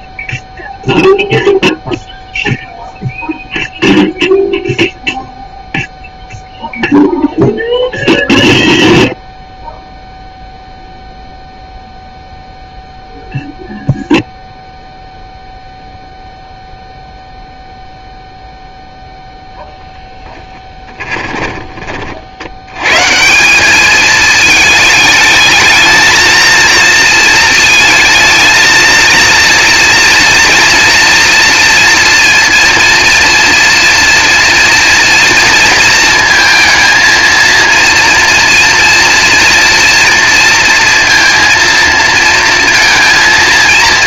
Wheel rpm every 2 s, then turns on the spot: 0, 0, 0, 0, 0, 0, 0, 0, 0, 0, 10, 70, 220, 220, 220, 230, 230, 230, 230, 230, 230, 230.
20-22